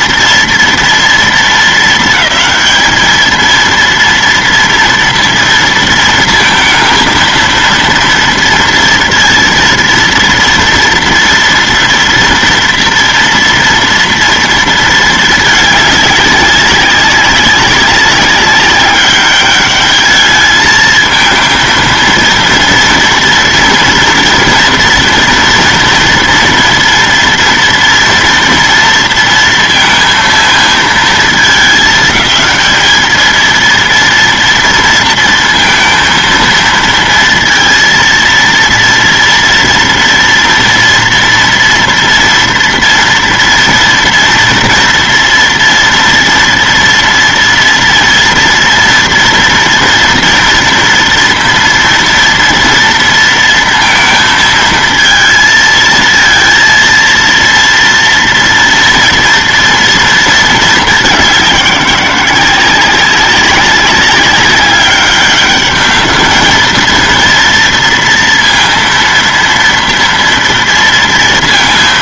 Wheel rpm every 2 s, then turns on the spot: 230, 220, 230, 230, 230, 230, 230, 230, 200, 200, 220, 230, 230, 230, 230, 230, 220, 230, 230, 230, 230, 230, 230, 230, 230, 230, 230, 230, 230, 230, 210, 190, 200, 220, 230, 230.
none